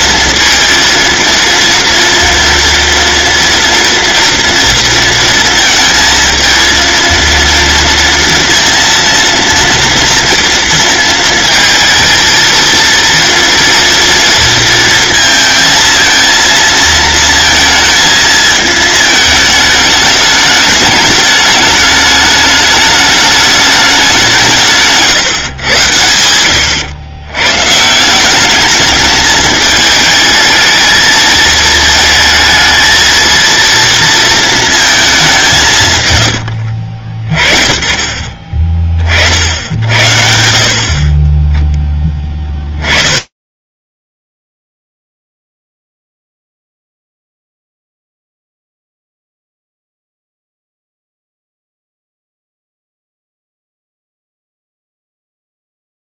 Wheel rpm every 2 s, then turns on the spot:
230, 230, 230, 230, 230, 230, 230, 230, 230, 220, 200, 210, 150, 100, 210, 220, 220, 210, 40, 40, 40, 20, 0, 0, 0, 0, 0, 0.
none